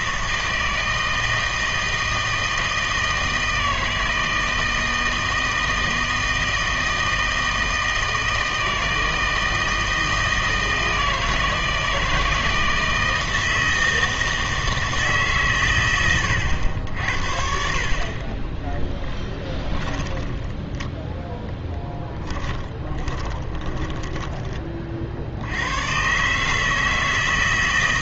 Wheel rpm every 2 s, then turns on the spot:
160, 160, 160, 160, 160, 160, 160, 160, 90, 10, 10, 10, 30, 160.
18-20 22-24